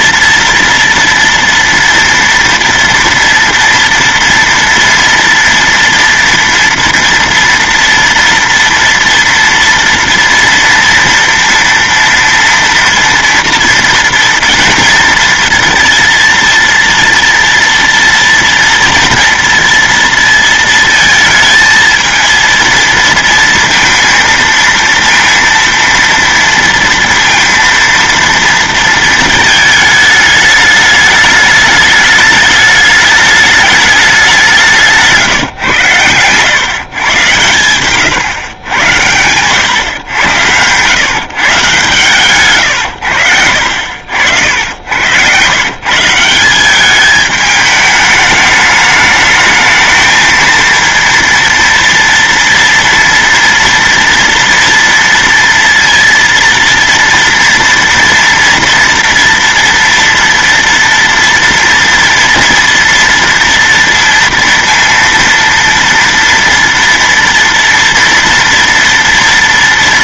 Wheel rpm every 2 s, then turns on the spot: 230, 230, 230, 230, 230, 230, 230, 230, 230, 230, 230, 230, 230, 230, 230, 210, 210, 160, 130, 100, 120, 110, 90, 200, 210, 230, 230, 230, 230, 230, 230, 230, 230, 230, 230.
34-36